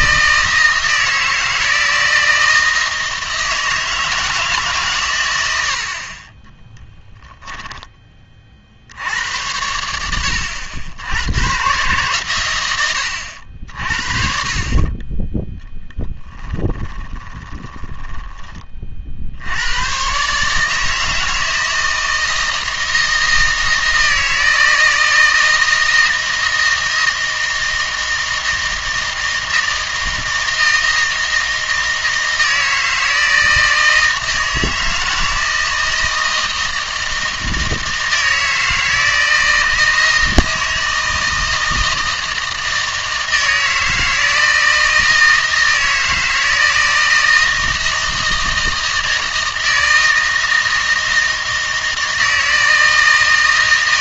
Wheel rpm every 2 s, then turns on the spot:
160, 160, 150, 10, 60, 80, 110, 30, 10, 30, 150, 160, 160, 160, 160, 160, 160, 160, 160, 160, 160, 160, 160, 160, 160, 160, 160.
6-8 16-18